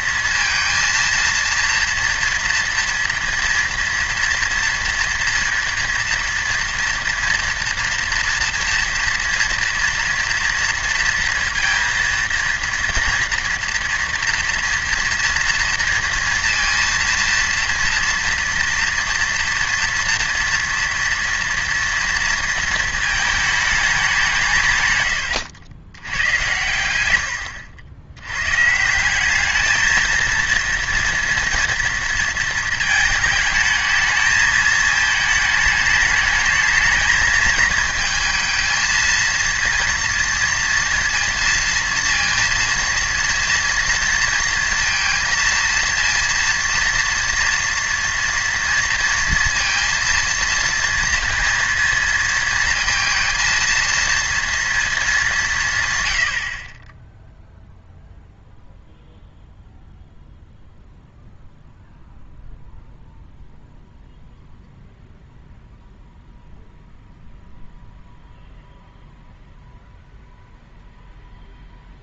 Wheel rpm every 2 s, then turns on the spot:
230, 230, 230, 230, 230, 230, 230, 230, 230, 230, 230, 230, 150, 100, 150, 230, 230, 220, 220, 220, 230, 230, 230, 230, 230, 230, 230, 230, 50, 0, 0, 0, 0, 0, 0, 0.
none